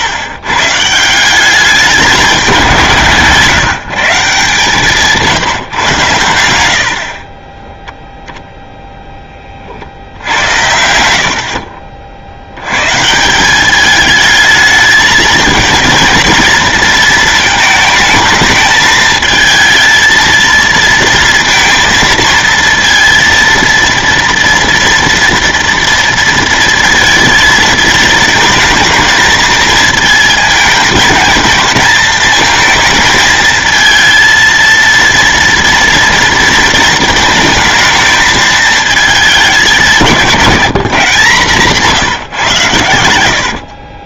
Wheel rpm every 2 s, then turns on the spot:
150, 160, 160, 70, 0, 90, 120, 220, 230, 220, 230, 230, 230, 220, 220, 220, 220, 230, 230, 220, 150, 110.
10-12 40-42